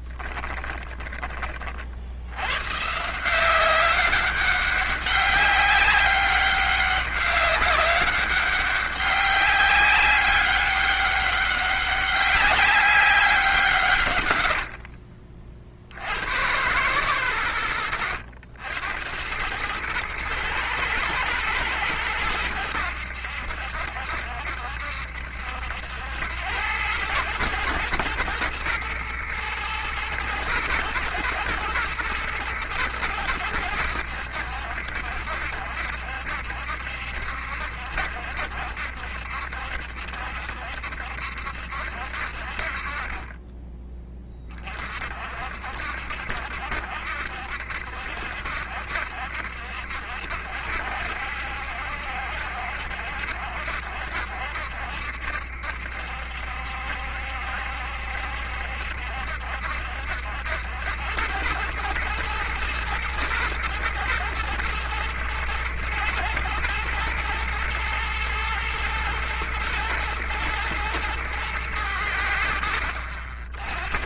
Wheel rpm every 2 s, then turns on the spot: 20, 150, 200, 190, 200, 200, 190, 60, 110, 90, 110, 90, 70, 100, 120, 110, 110, 70, 70, 70, 70, 60, 30, 70, 70, 70, 70, 70, 70, 70, 80, 110, 120, 110, 110, 120, 80.
0-2 14-16